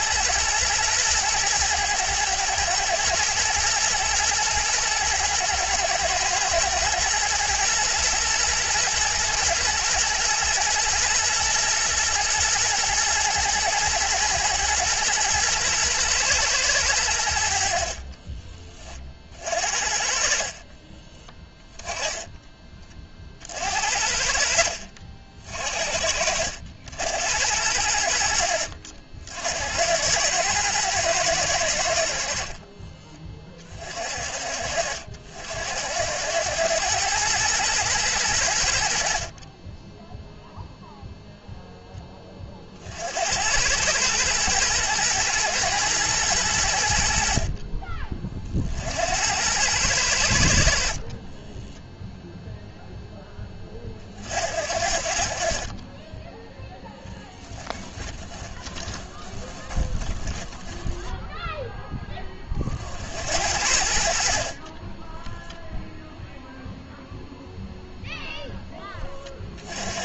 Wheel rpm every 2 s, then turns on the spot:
110, 120, 110, 120, 120, 120, 120, 110, 100, 40, 30, 40, 50, 80, 70, 110, 20, 60, 110, 60, 0, 50, 120, 70, 70, 50, 0, 50, 10, 20, 10, 60, 20, 0, 20.
20-22 56-62